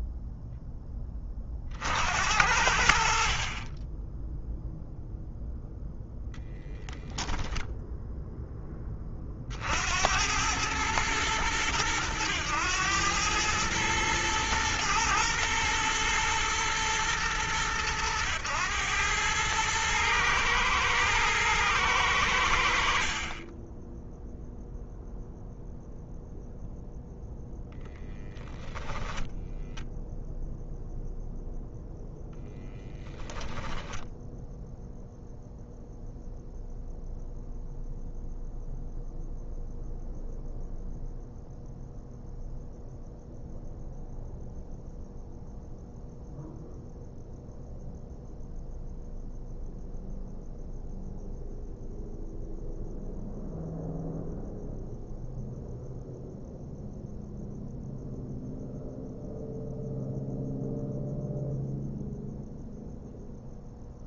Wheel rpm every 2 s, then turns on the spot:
0, 70, 0, 0, 10, 100, 100, 110, 110, 110, 110, 70, 0, 0, 10, 0, 10, 0, 0, 0, 0, 0, 0, 0, 0, 0, 0, 0, 0, 0, 0, 0.
none